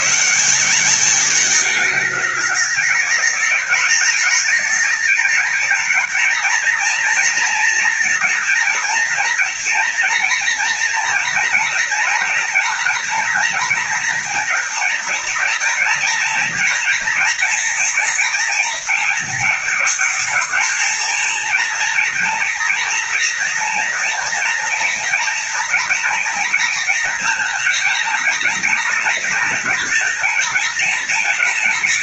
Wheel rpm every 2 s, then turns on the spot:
190, 210, 220, 230, 230, 230, 240, 230, 230, 230, 230, 230, 230, 230, 230, 220.
none